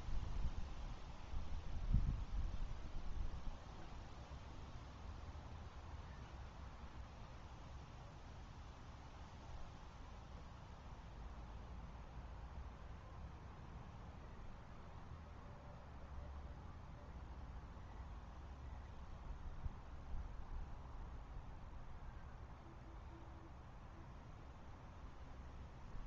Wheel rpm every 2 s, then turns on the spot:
0, 0, 0, 0, 0, 0, 0, 0, 0, 0, 0, 0, 0.
none